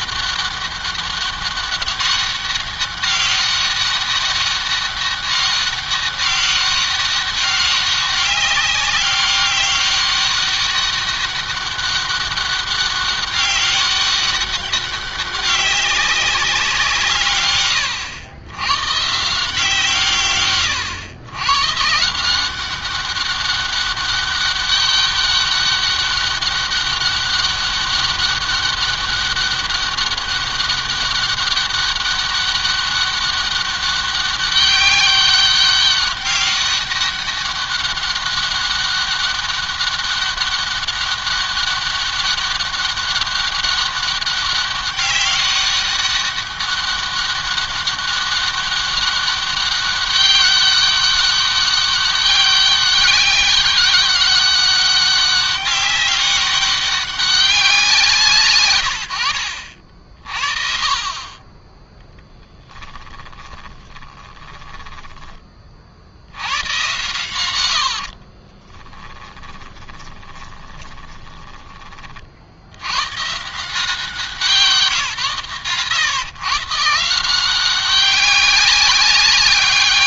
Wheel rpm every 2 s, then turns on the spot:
200, 200, 200, 200, 200, 200, 200, 200, 180, 120, 120, 190, 200, 200, 200, 200, 200, 200, 200, 200, 200, 200, 190, 200, 200, 200, 200, 200, 200, 120, 40, 10, 10, 110, 20, 20, 90, 150, 140, 190.
62-66 68-72